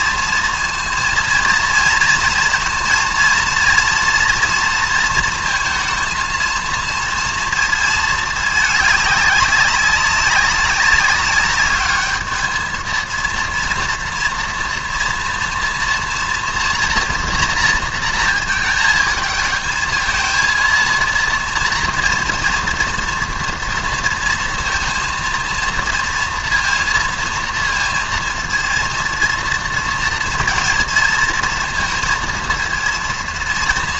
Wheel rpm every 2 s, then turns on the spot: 230, 230, 230, 230, 210, 200, 220, 230, 230, 220, 230, 230, 230, 230, 230, 230, 230.
none